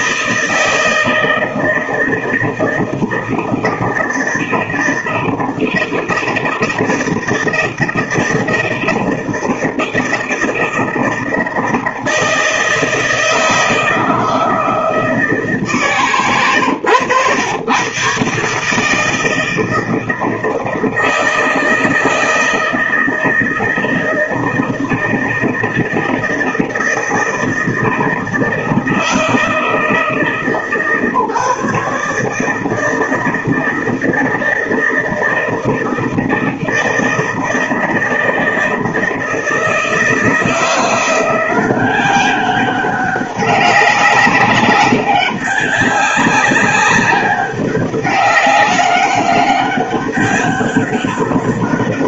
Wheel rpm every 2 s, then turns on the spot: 160, 160, 160, 160, 170, 160, 160, 160, 120, 140, 160, 160, 160, 160, 160, 160, 150, 160, 160, 160, 160, 190, 190, 200, 200, 200.
none